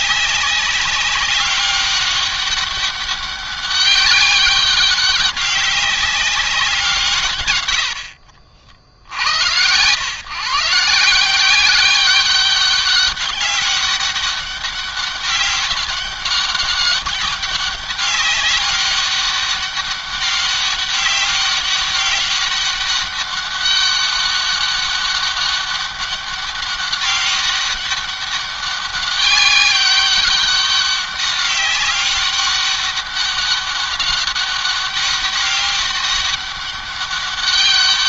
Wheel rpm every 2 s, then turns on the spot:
190, 200, 200, 190, 60, 150, 200, 200, 200, 200, 200, 200, 200, 200, 200, 200, 200, 200, 200.
none